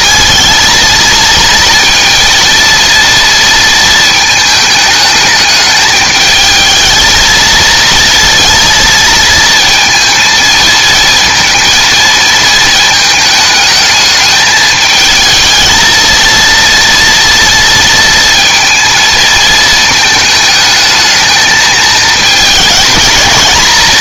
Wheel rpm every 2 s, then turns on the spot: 230, 230, 220, 220, 230, 230, 220, 220, 230, 230, 210, 210.
none